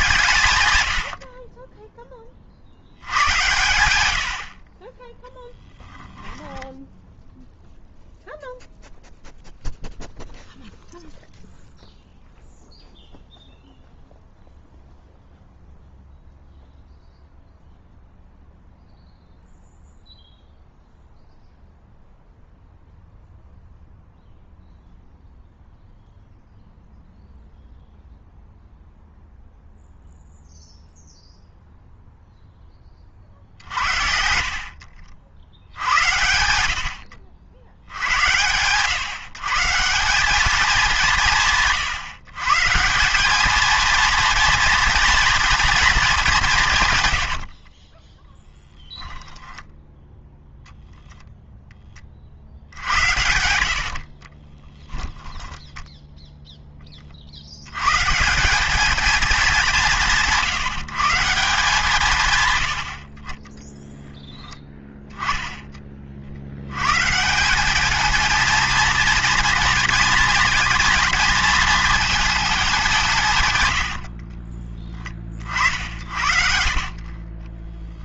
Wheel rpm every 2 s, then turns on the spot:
130, 70, 50, 10, 0, 0, 0, 0, 0, 0, 0, 0, 0, 0, 0, 0, 10, 60, 80, 120, 200, 140, 240, 160, 10, 20, 70, 20, 10, 190, 160, 110, 10, 80, 230, 220, 200, 20, 60.
6-8 48-50 54-56 62-64